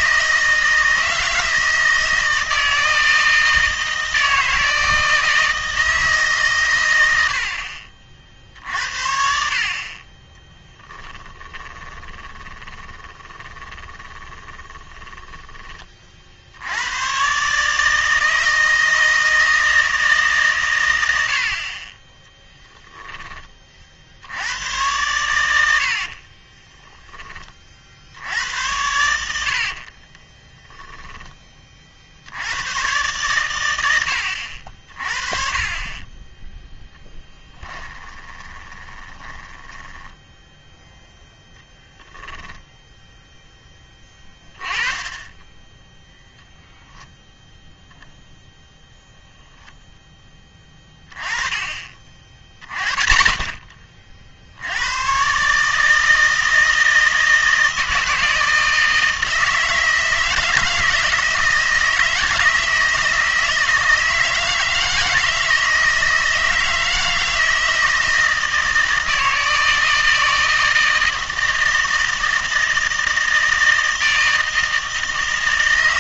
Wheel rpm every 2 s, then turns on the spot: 160, 160, 160, 110, 60, 10, 20, 20, 90, 160, 110, 10, 110, 10, 90, 10, 100, 40, 10, 10, 0, 0, 20, 0, 0, 20, 30, 90, 160, 160, 160, 160, 160, 160, 160, 160, 160, 160.
10-16 26-28 30-32 38-40